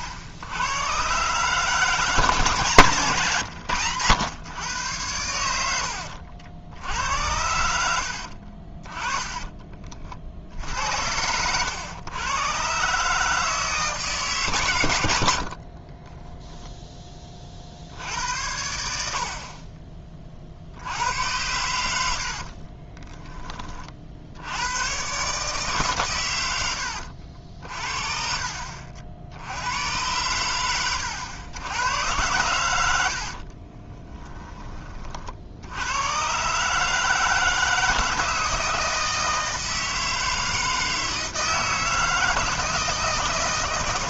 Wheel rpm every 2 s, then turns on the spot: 100, 160, 110, 70, 50, 60, 130, 120, 10, 80, 50, 40, 90, 110, 40, 100, 100, 30, 140, 160, 160, 160.
8-10 22-24 34-36